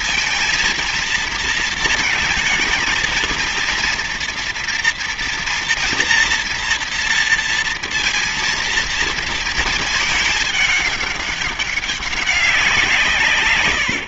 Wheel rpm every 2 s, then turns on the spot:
230, 220, 230, 230, 230, 220, 190.
none